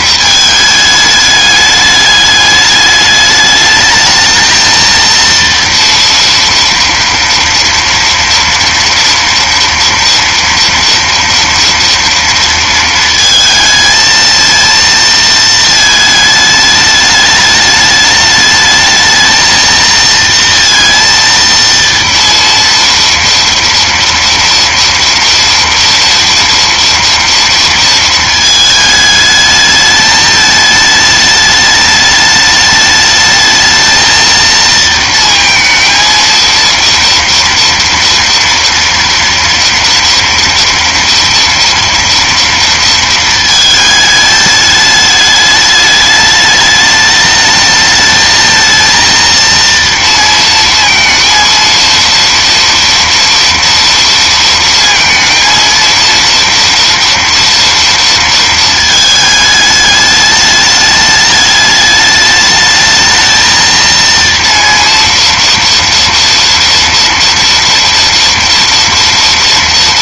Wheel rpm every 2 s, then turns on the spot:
220, 210, 230, 230, 230, 230, 230, 230, 210, 220, 230, 230, 230, 230, 220, 210, 210, 230, 230, 230, 230, 230, 210, 210, 230, 230, 230, 230, 230, 220, 210, 210, 230, 230, 230.
none